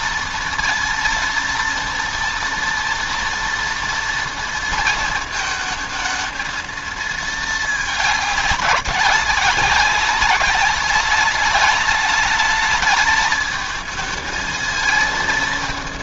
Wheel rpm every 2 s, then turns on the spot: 230, 230, 230, 220, 200, 200, 210, 220.
none